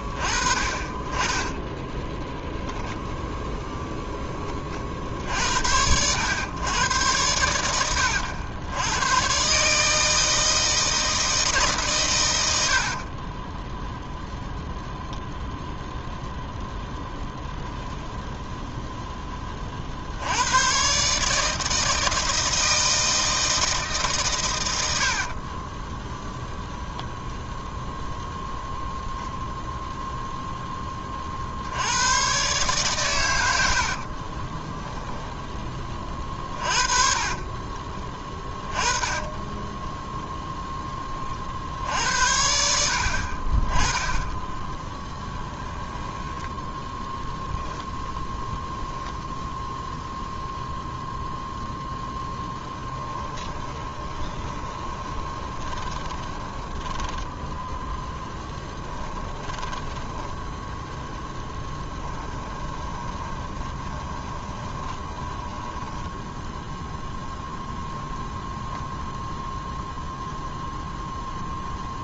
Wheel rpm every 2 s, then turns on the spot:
20, 0, 40, 110, 90, 160, 70, 0, 0, 0, 110, 160, 100, 0, 0, 10, 130, 10, 40, 20, 10, 70, 20, 10, 10, 0, 10, 20, 10, 10, 10, 20, 20, 0, 0, 0.
12-14 34-38 44-48 52-66